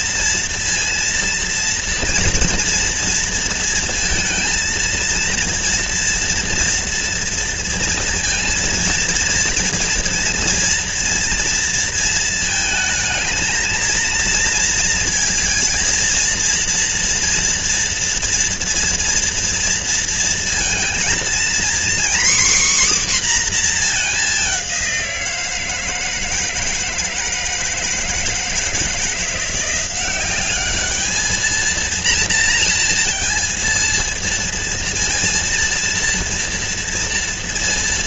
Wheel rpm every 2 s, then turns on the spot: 230, 230, 230, 230, 230, 230, 220, 230, 230, 230, 230, 270, 180, 160, 160, 210, 230, 230, 230.
none